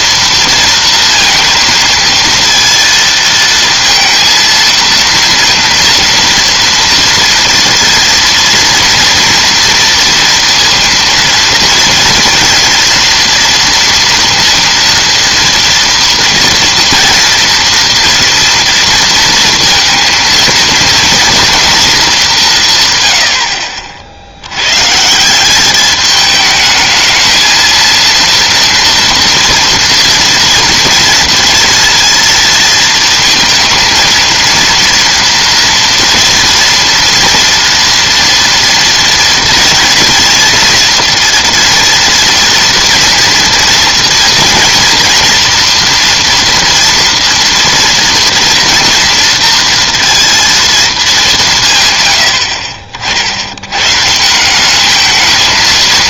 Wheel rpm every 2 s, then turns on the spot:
230, 230, 230, 230, 230, 230, 230, 230, 230, 230, 230, 160, 110, 210, 230, 230, 230, 230, 230, 230, 230, 240, 230, 230, 230, 230, 60, 190.
none